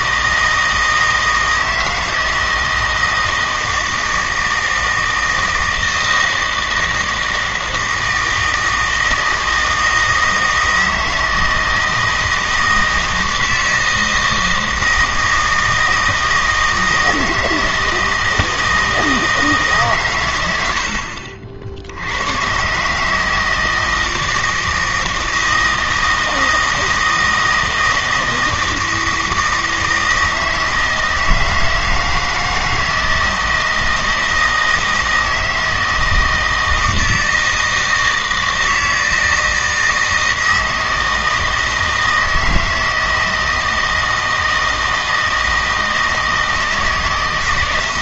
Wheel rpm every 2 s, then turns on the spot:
160, 160, 160, 160, 160, 160, 160, 160, 160, 160, 70, 140, 160, 160, 160, 160, 160, 160, 160, 160, 160, 160, 160, 160.
none